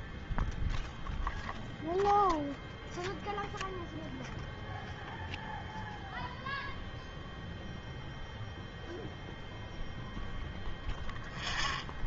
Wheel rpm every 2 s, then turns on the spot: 0, 0, 0, 0, 0, 0.
none